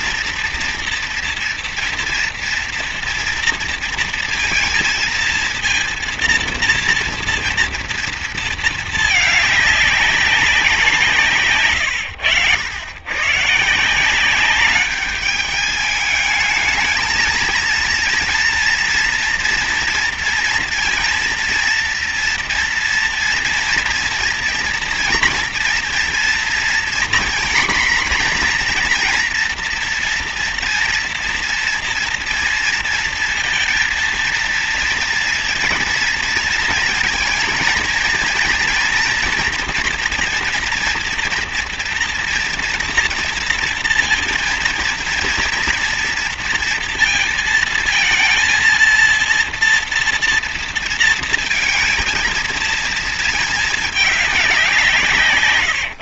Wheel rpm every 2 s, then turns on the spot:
230, 230, 230, 230, 220, 180, 100, 200, 220, 230, 230, 230, 230, 240, 250, 240, 230, 230, 230, 230, 230, 230, 230, 230, 230, 230, 230, 190.
none